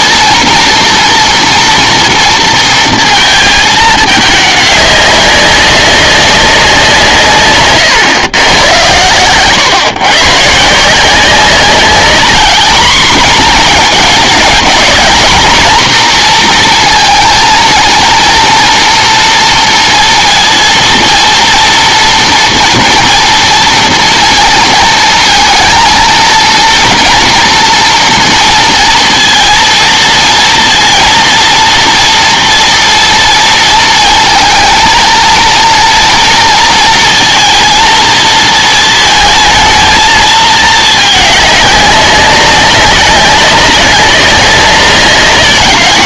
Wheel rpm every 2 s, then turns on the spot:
230, 230, 210, 180, 110, 150, 230, 210, 230, 230, 230, 230, 230, 230, 230, 230, 230, 230, 230, 220, 220, 200, 190.
none